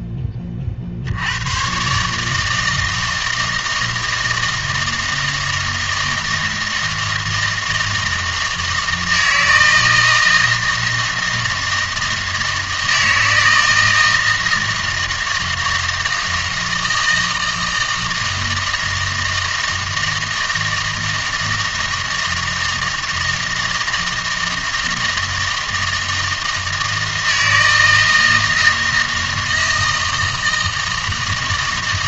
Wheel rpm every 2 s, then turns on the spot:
50, 160, 160, 160, 160, 160, 160, 160, 160, 160, 160, 160, 160, 160, 160, 160.
none